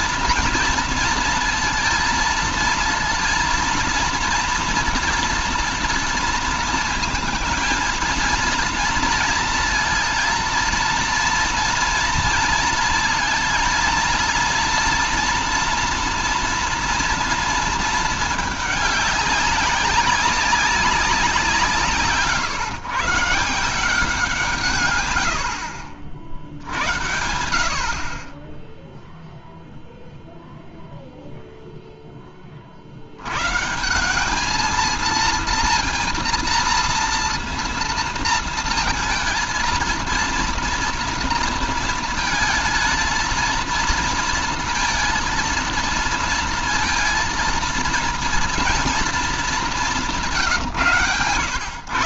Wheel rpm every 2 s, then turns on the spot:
230, 230, 230, 230, 230, 230, 230, 230, 240, 210, 200, 150, 150, 70, 30, 0, 30, 210, 230, 230, 230, 230, 230, 230, 230, 170.
none